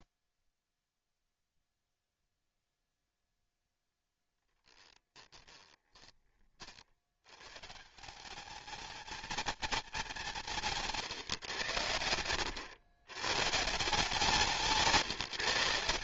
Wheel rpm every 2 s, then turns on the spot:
0, 0, 10, 60, 220, 160, 90, 170.
4-6